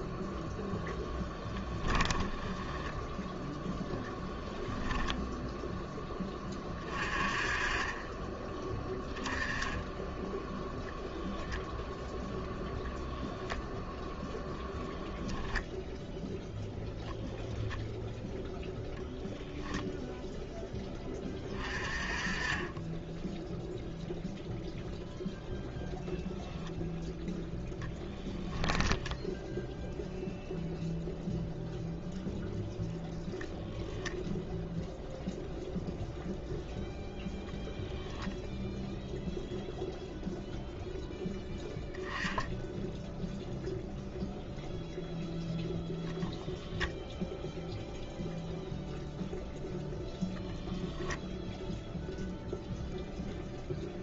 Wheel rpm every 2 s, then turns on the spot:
0, 10, 0, 30, 10, 10, 0, 0, 0, 0, 10, 20, 0, 0, 10, 0, 0, 0, 0, 0, 0, 0, 0, 0, 0, 0, 0.
2-4 28-30